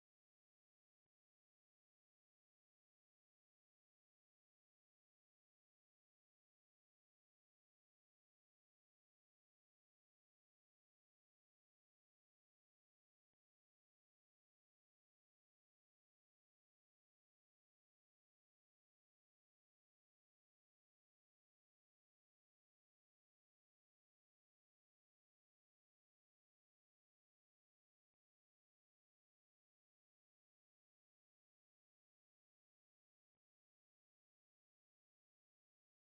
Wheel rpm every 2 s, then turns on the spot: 0, 0, 0, 0, 0, 0, 0, 0, 0, 0, 0, 0, 0, 0, 0, 0, 0, 0.
none